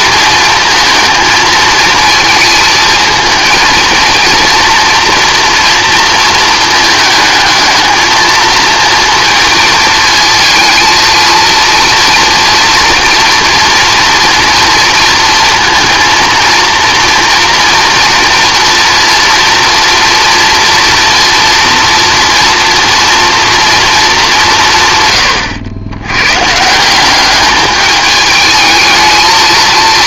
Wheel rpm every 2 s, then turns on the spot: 220, 220, 230, 220, 230, 230, 230, 230, 230, 230, 230, 230, 140, 180, 220.
none